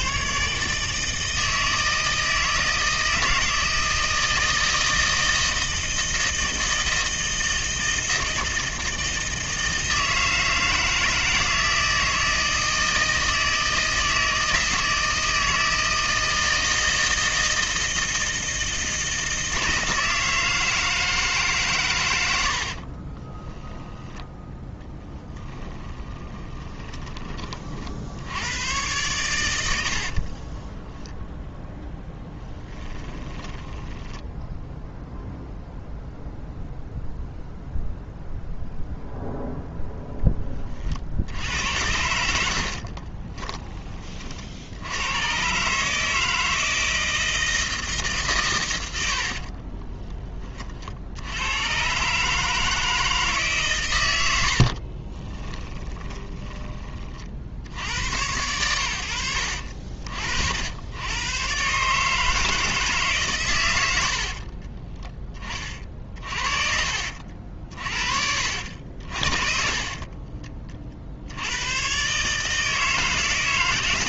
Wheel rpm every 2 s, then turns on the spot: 150, 160, 160, 160, 160, 160, 160, 160, 160, 160, 160, 70, 10, 20, 110, 30, 20, 0, 0, 0, 30, 60, 70, 160, 110, 40, 160, 60, 20, 100, 70, 160, 30, 40, 60, 40, 160.
22-24 26-28 30-34 42-44 54-56 64-66